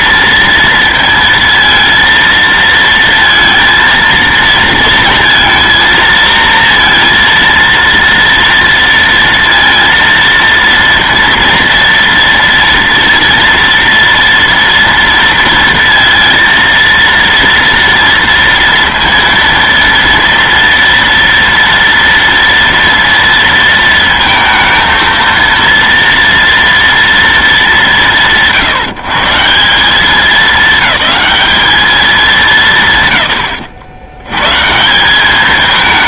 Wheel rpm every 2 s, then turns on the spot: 230, 230, 230, 230, 230, 230, 230, 230, 230, 230, 230, 230, 220, 230, 170, 200, 210, 110.
none